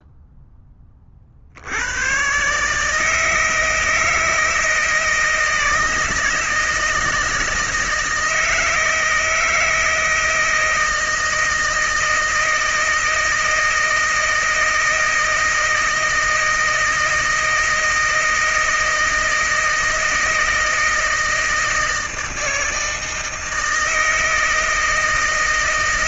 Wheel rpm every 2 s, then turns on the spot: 30, 160, 160, 160, 160, 160, 160, 160, 160, 160, 160, 160, 160.
none